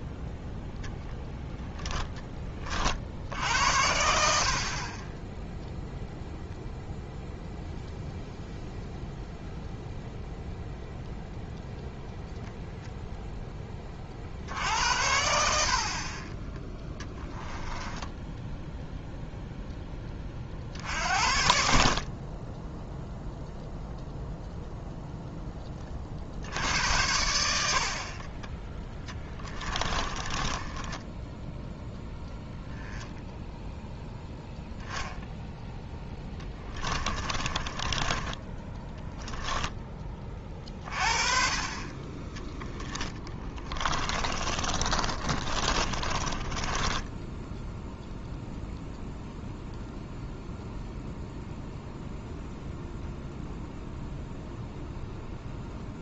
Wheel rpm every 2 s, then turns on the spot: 0, 40, 40, 0, 0, 0, 0, 70, 10, 0, 50, 10, 0, 70, 10, 20, 0, 10, 20, 20, 40, 10, 30, 20, 0, 0, 0, 0.
16-18 30-32 36-40 42-48